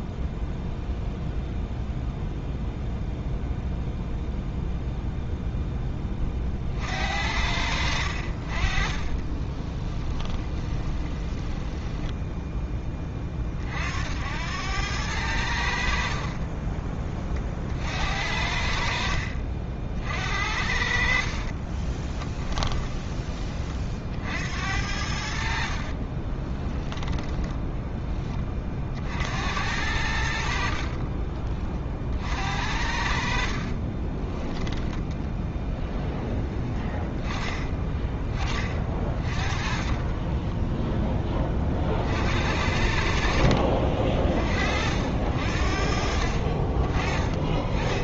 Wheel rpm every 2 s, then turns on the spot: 0, 0, 0, 50, 50, 10, 20, 90, 30, 60, 60, 10, 70, 20, 40, 70, 50, 10, 20, 30, 20, 70, 50, 40.
10-12 16-18 22-24 26-28 34-36 40-42